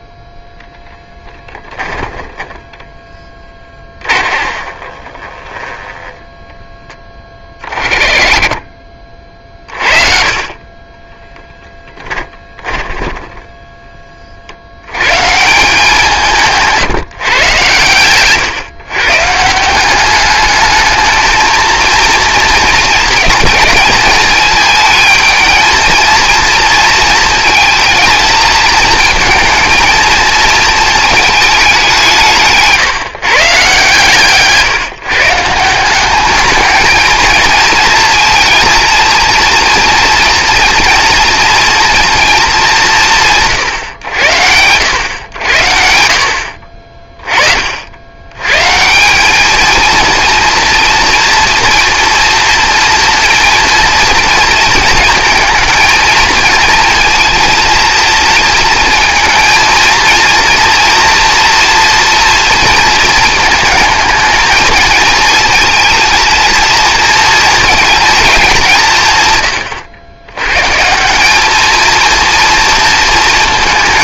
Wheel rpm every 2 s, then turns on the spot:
10, 10, 30, 10, 40, 30, 10, 50, 160, 130, 210, 230, 220, 230, 220, 220, 150, 140, 210, 230, 230, 220, 90, 60, 120, 230, 230, 230, 230, 230, 230, 230, 220, 230, 200, 130, 230.
2-8 12-14